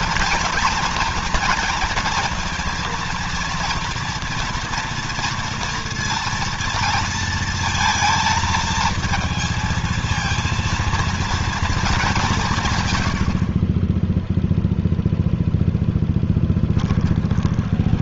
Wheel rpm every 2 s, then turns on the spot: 230, 230, 230, 230, 230, 230, 160, 0, 10.
none